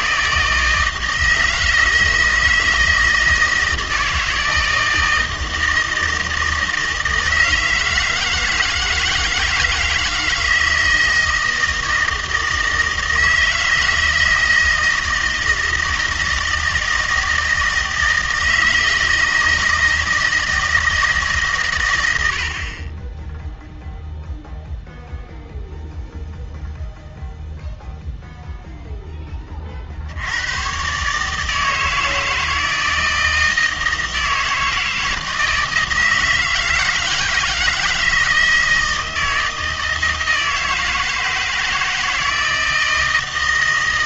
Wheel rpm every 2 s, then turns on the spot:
160, 160, 160, 160, 160, 160, 160, 160, 160, 160, 140, 10, 0, 0, 20, 150, 160, 160, 160, 160, 160, 160.
none